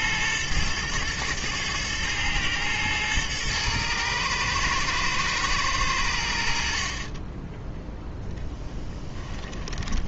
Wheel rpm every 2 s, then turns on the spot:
110, 110, 120, 50, 10.
8-10